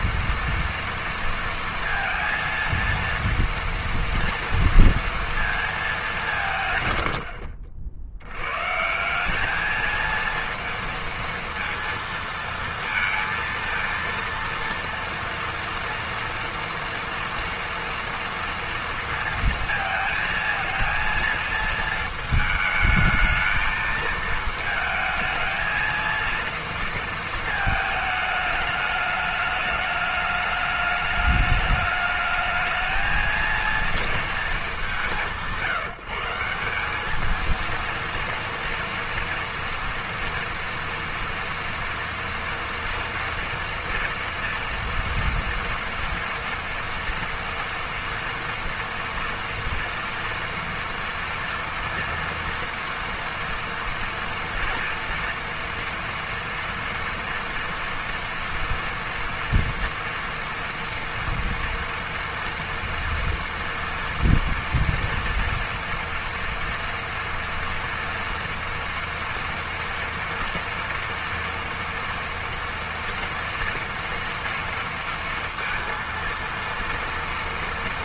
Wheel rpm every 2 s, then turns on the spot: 230, 230, 230, 140, 140, 230, 230, 230, 230, 230, 230, 220, 220, 230, 210, 210, 220, 190, 190, 230, 230, 230, 230, 230, 230, 240, 230, 240, 240, 230, 230, 230, 240, 230, 240, 230, 230, 230, 230.
none